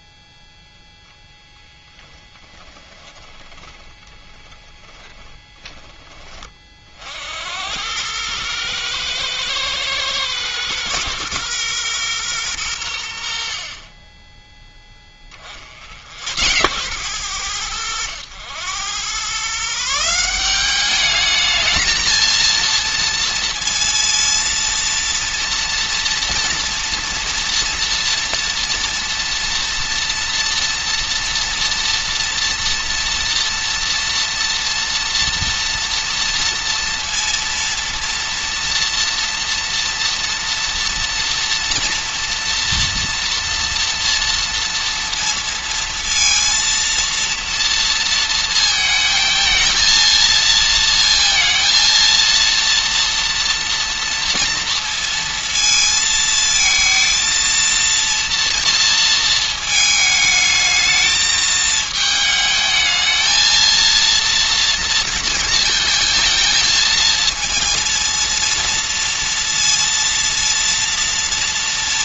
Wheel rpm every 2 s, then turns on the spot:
0, 10, 10, 30, 110, 120, 100, 10, 100, 100, 200, 230, 230, 230, 230, 230, 230, 230, 230, 230, 230, 230, 230, 230, 220, 230, 230, 230, 230, 230, 220, 220, 230, 230, 230, 230.
4-6